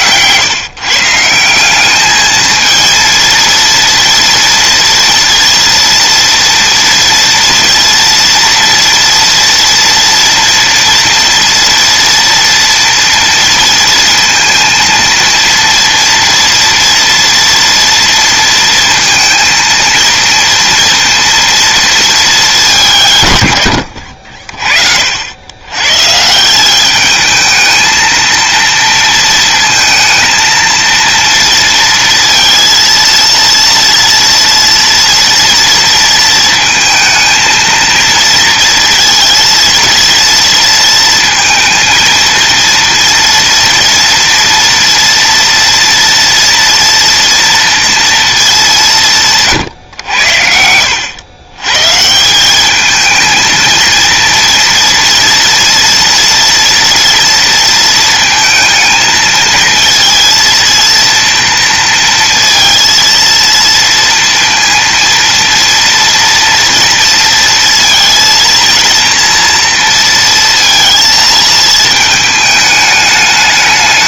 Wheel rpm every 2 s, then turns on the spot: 160, 230, 240, 230, 240, 230, 230, 230, 230, 230, 230, 130, 70, 210, 230, 230, 230, 230, 220, 230, 230, 230, 230, 230, 170, 90, 220, 230, 230, 230, 230, 230, 230, 230, 230, 230, 220.
none